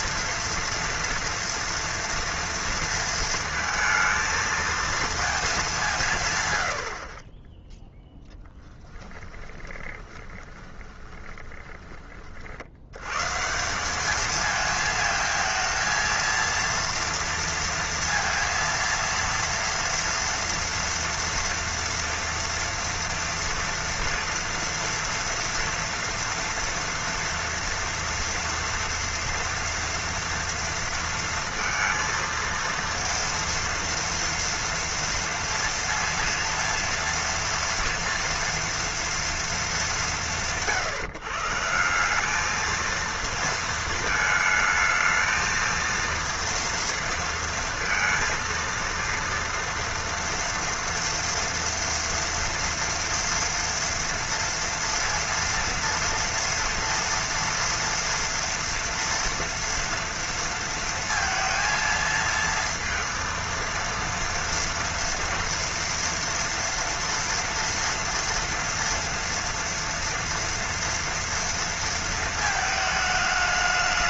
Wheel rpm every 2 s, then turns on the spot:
230, 230, 220, 90, 10, 20, 70, 220, 230, 230, 230, 230, 230, 230, 230, 230, 230, 230, 230, 230, 130, 220, 220, 230, 230, 230, 230, 230, 230, 230, 230, 230, 230, 230, 230, 230, 220.
8-12